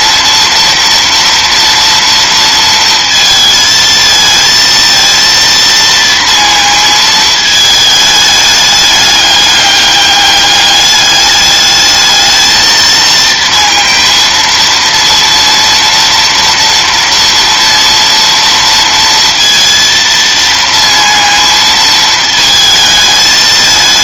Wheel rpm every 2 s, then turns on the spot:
230, 220, 230, 220, 210, 210, 230, 230, 230, 230, 230, 220.
none